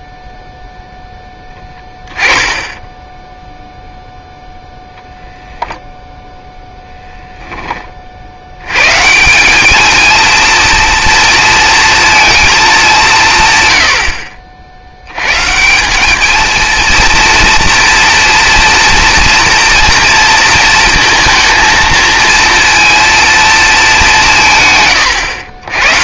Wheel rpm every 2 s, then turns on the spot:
0, 10, 0, 10, 130, 230, 200, 90, 230, 230, 220, 230, 120.
2-4